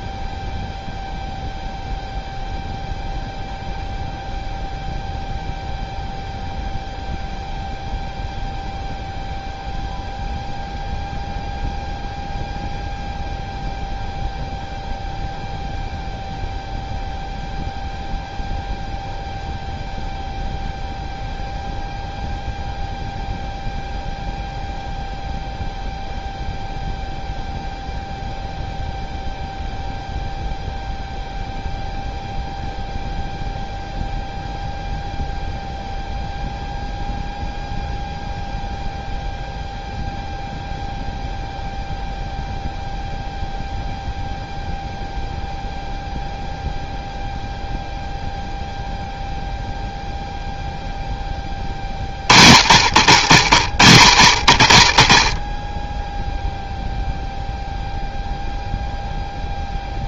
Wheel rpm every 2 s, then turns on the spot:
0, 0, 0, 0, 0, 0, 0, 0, 0, 0, 0, 0, 0, 0, 0, 0, 0, 0, 0, 0, 0, 0, 0, 0, 0, 0, 70, 50, 0, 0.
none